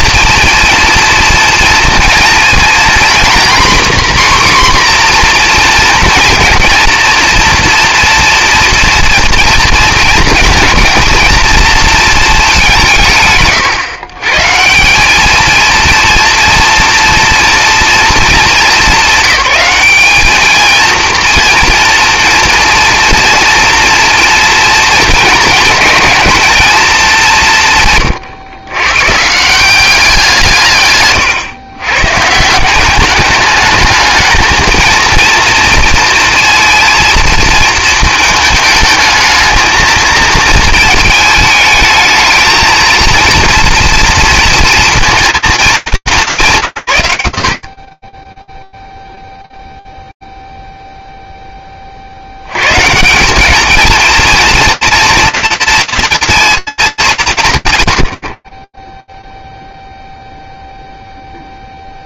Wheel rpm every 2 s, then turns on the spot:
230, 230, 260, 230, 230, 230, 160, 160, 230, 220, 230, 230, 230, 220, 120, 150, 180, 220, 230, 220, 220, 220, 230, 100, 10, 0, 100, 230, 230, 40, 0.
none